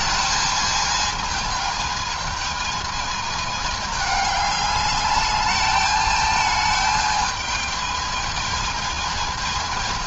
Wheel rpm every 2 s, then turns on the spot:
220, 220, 210, 220, 220.
none